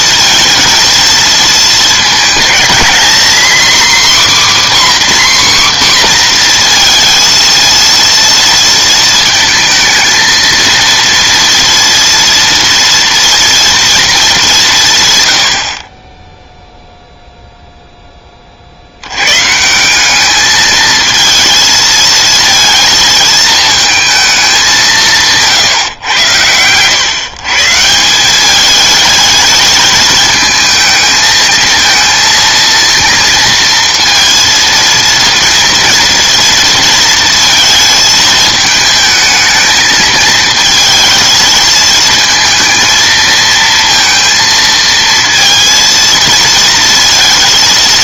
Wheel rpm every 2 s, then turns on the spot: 230, 230, 280, 230, 230, 230, 230, 170, 0, 60, 220, 220, 190, 110, 210, 220, 230, 230, 230, 220, 220, 230, 230, 230.
none